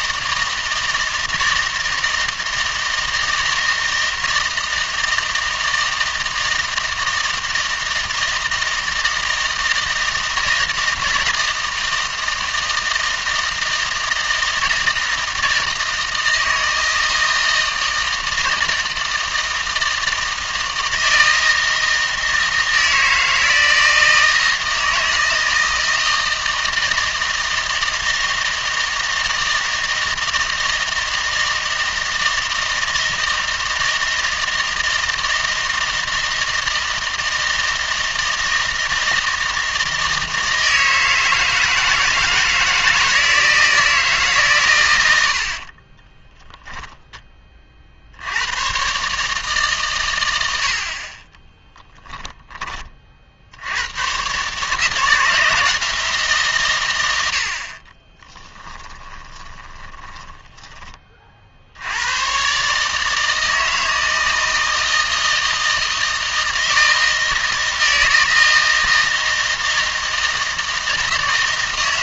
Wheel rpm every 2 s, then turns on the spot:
160, 160, 160, 160, 160, 160, 160, 160, 160, 160, 160, 160, 160, 160, 160, 160, 160, 160, 160, 160, 160, 160, 120, 10, 120, 60, 30, 150, 120, 20, 20, 150, 160, 160, 160, 160.
58-60